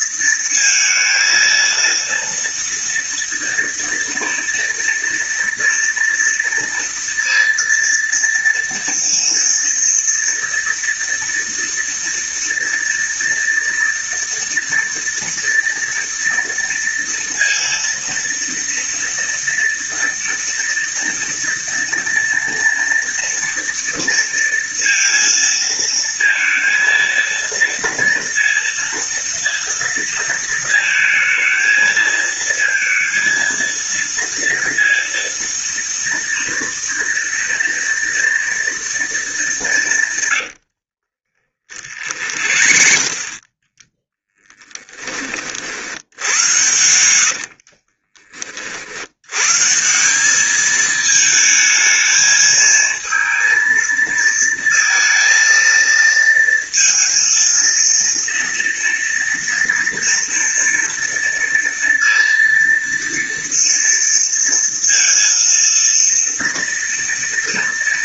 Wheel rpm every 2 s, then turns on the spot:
230, 230, 230, 230, 230, 230, 230, 230, 230, 230, 230, 230, 230, 230, 230, 230, 230, 230, 230, 220, 50, 40, 20, 80, 80, 220, 220, 230, 230, 230, 230, 230, 230, 230.
40-44 46-48